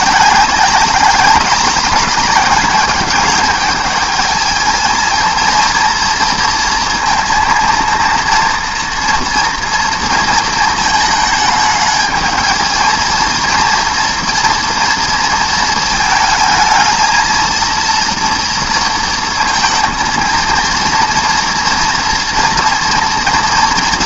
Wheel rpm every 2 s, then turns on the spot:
200, 210, 220, 230, 230, 220, 220, 230, 220, 230, 230, 240.
none